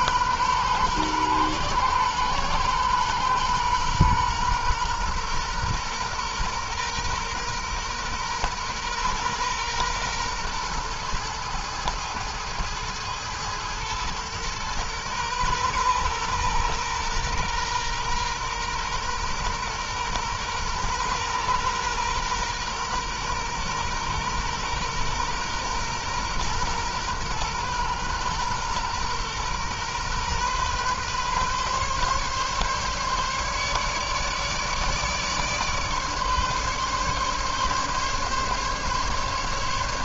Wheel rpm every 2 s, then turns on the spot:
120, 120, 120, 120, 120, 120, 110, 120, 120, 120, 120, 120, 120, 120, 120, 120, 140, 150, 140, 140.
none